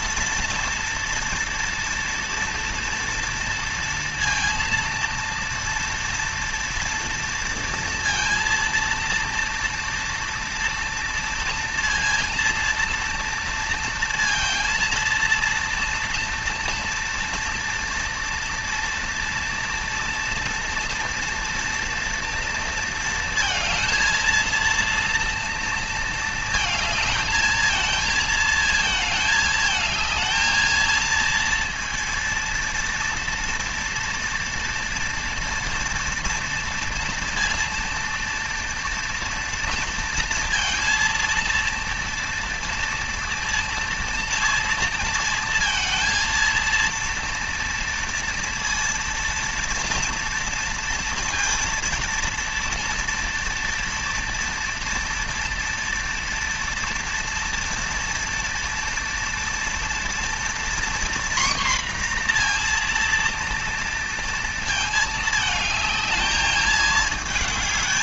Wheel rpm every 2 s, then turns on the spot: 230, 230, 230, 230, 230, 230, 230, 230, 230, 230, 230, 230, 230, 220, 220, 230, 230, 240, 230, 230, 230, 230, 230, 230, 230, 230, 230, 230, 230, 230, 240, 240, 220, 220.
none